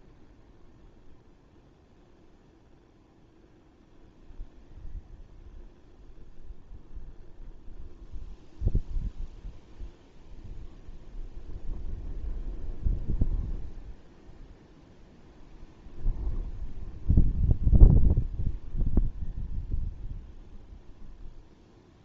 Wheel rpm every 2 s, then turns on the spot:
0, 0, 0, 0, 0, 0, 0, 0, 0, 0, 0.
none